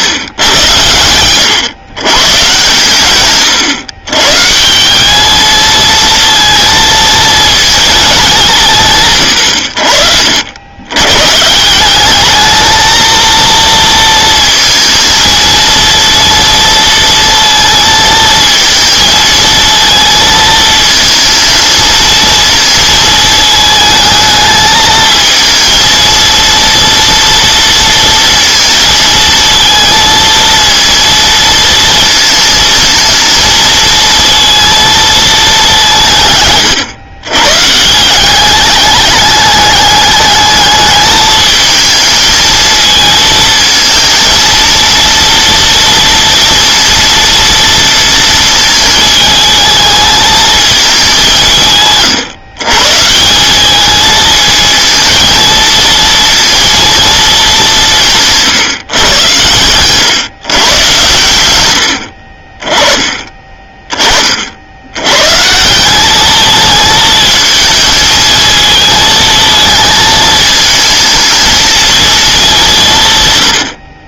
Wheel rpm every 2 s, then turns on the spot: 120, 120, 150, 230, 180, 80, 220, 230, 230, 230, 230, 230, 220, 230, 230, 230, 220, 230, 120, 200, 210, 220, 230, 230, 220, 220, 150, 220, 230, 160, 130, 30, 60, 220, 220, 220, 200.
none